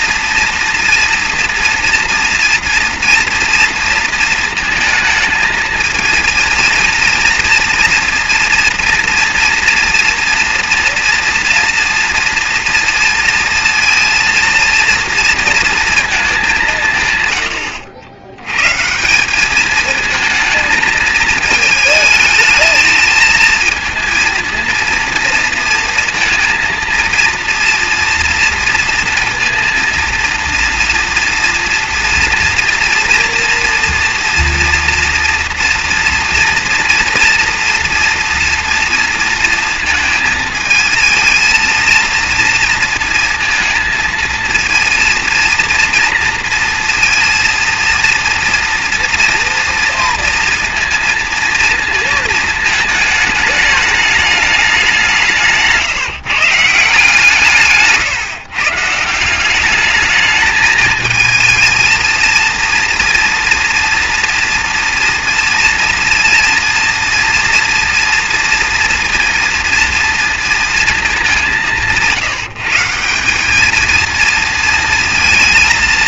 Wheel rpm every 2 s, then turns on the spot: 240, 230, 230, 230, 230, 230, 230, 230, 200, 100, 220, 220, 230, 230, 230, 230, 240, 230, 230, 240, 230, 230, 230, 230, 230, 240, 220, 210, 170, 150, 220, 230, 230, 230, 230, 230, 160, 230.
none